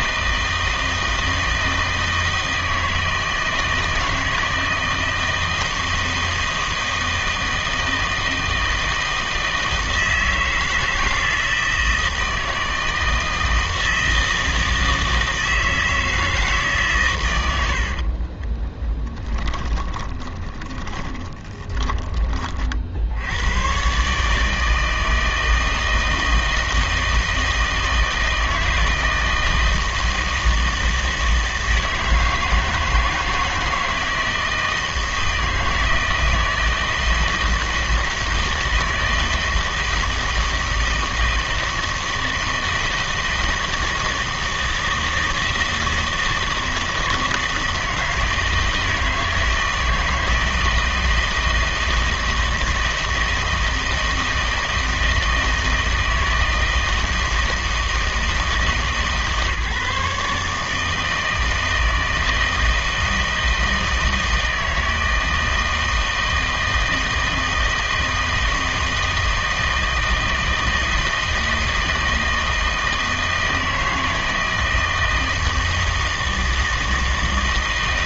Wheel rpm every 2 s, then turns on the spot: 160, 160, 160, 160, 160, 160, 160, 160, 150, 30, 20, 40, 160, 160, 160, 160, 160, 160, 160, 160, 160, 160, 160, 160, 160, 160, 160, 160, 160, 160, 150, 160, 160, 160, 160, 160, 160, 160, 160.
18-22